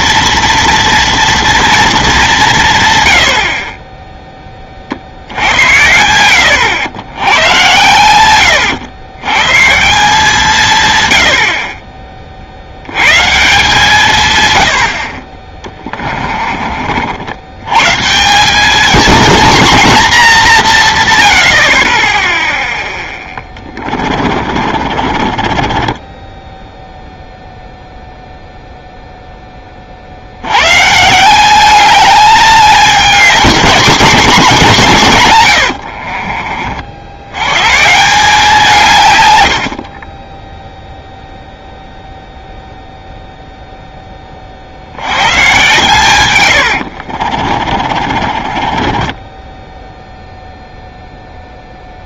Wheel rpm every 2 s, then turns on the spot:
230, 150, 30, 80, 110, 140, 80, 90, 40, 200, 190, 0, 40, 10, 0, 120, 210, 210, 60, 160, 0, 0, 50, 100, 20, 0.
24-28 46-50